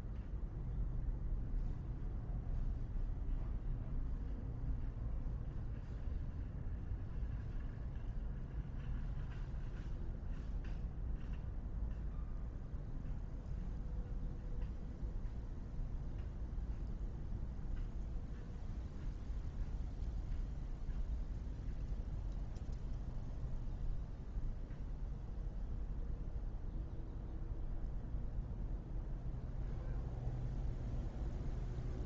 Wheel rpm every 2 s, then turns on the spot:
0, 0, 0, 0, 0, 0, 0, 0, 0, 0, 0, 0, 0, 0, 0, 0.
none